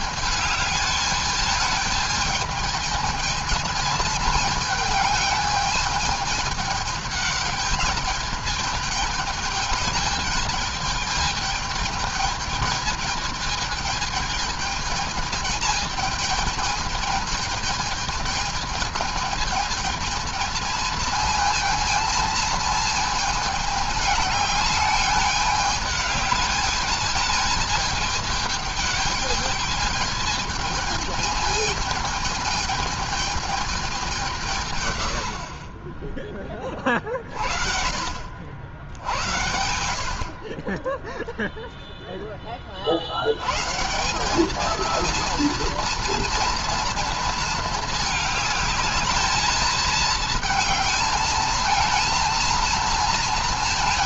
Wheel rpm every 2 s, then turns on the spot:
210, 220, 220, 210, 220, 210, 220, 220, 220, 220, 220, 220, 210, 210, 210, 220, 220, 100, 30, 70, 10, 50, 230, 230, 210, 220, 230.
none